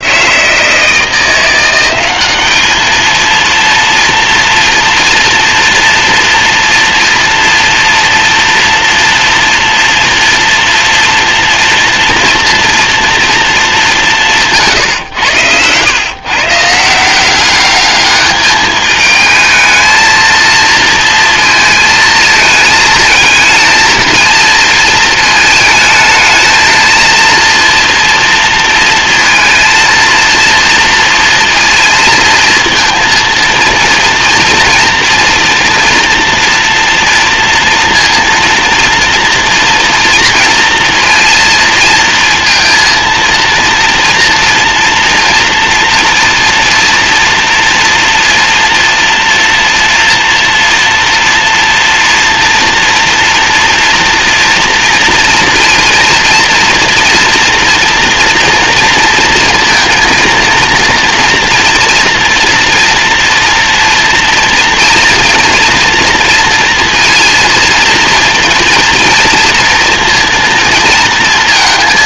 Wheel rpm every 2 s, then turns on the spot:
160, 220, 240, 230, 230, 230, 230, 130, 170, 220, 230, 220, 220, 230, 230, 230, 230, 230, 230, 230, 230, 230, 240, 230, 230, 230, 230, 230, 230, 230, 230, 230, 230, 230, 230, 230.
none